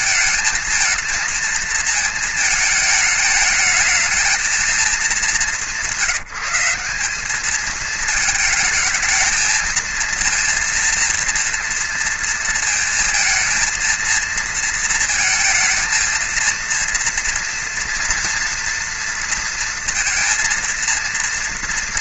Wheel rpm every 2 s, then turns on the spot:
220, 220, 220, 190, 220, 230, 230, 230, 230, 230, 230.
none